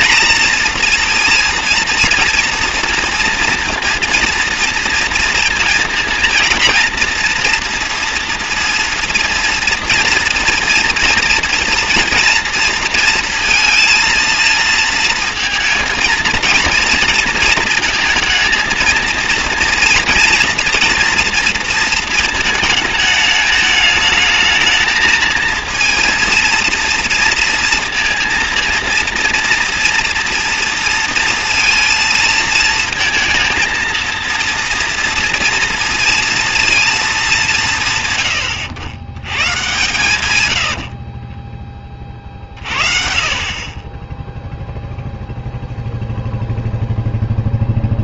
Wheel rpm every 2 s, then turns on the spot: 230, 240, 230, 230, 230, 230, 230, 230, 230, 220, 230, 220, 220, 230, 230, 230, 220, 230, 230, 90, 90, 40, 0, 0.
40-42